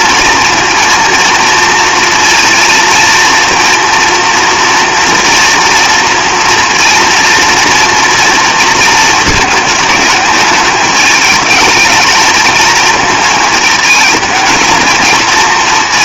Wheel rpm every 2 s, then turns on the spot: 230, 230, 230, 240, 230, 210, 220, 220.
none